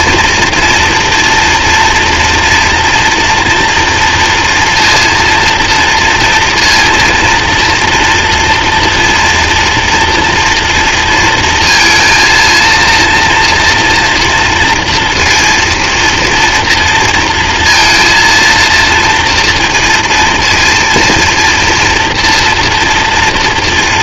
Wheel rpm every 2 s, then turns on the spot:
230, 230, 230, 230, 230, 230, 230, 240, 230, 230, 230, 230.
none